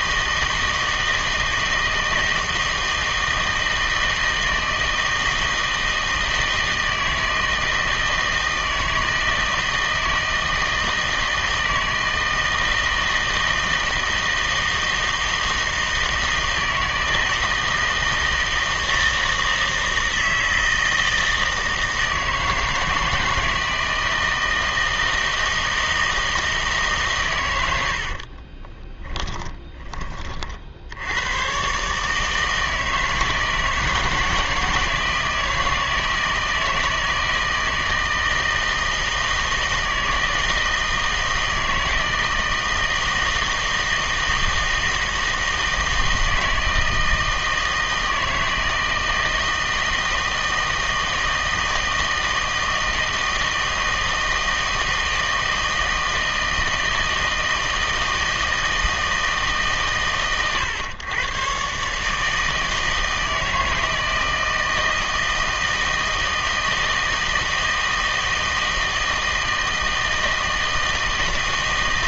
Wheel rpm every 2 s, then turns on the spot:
160, 160, 160, 160, 160, 160, 160, 160, 160, 160, 160, 160, 160, 150, 20, 60, 160, 160, 160, 160, 160, 160, 160, 160, 160, 160, 160, 160, 160, 160, 110, 160, 160, 160, 160, 160.
28-30